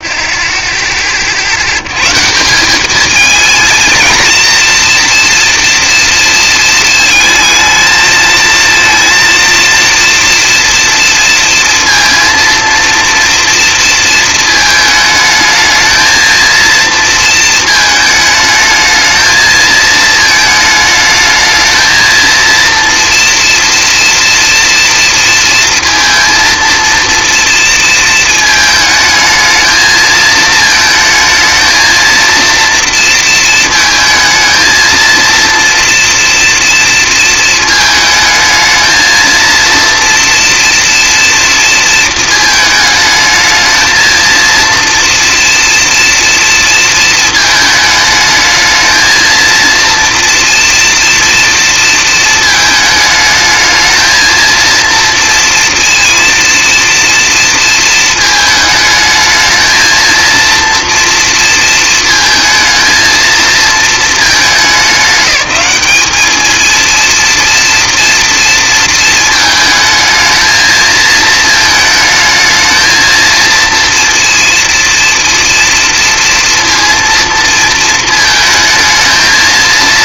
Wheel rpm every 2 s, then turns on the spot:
10, 210, 230, 220, 230, 230, 230, 220, 230, 220, 210, 230, 230, 230, 220, 220, 230, 220, 230, 220, 230, 220, 230, 230, 220, 230, 220, 230, 240, 220, 230, 220, 210, 220, 230, 220, 230, 230, 230, 220.
none